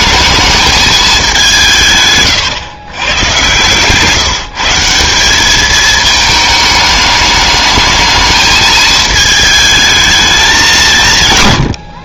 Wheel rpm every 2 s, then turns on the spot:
220, 130, 160, 210, 220, 180.
none